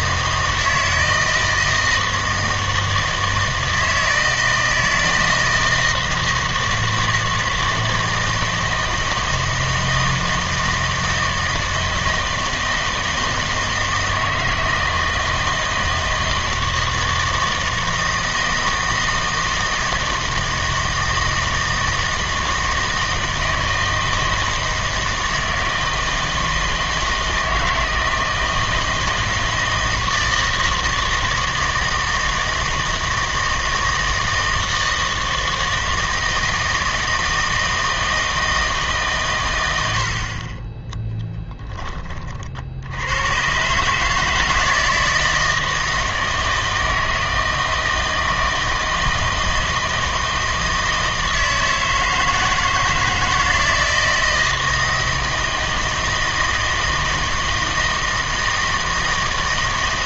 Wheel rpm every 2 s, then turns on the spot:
160, 160, 160, 160, 160, 160, 160, 160, 160, 160, 160, 160, 160, 160, 160, 160, 160, 160, 160, 160, 30, 60, 160, 160, 160, 160, 160, 160, 160, 160.
none